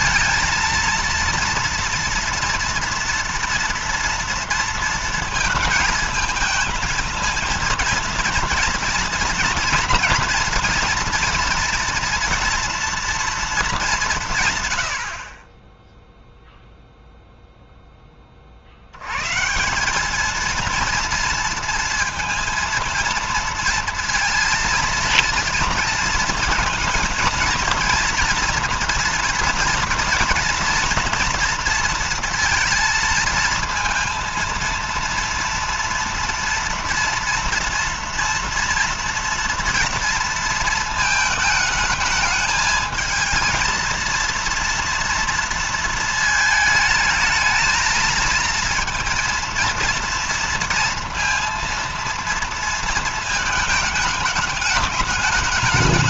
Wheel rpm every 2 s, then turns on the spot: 230, 240, 230, 220, 240, 230, 230, 140, 0, 50, 220, 230, 230, 220, 230, 230, 230, 230, 230, 230, 230, 220, 230, 220, 220, 230, 230, 210.
none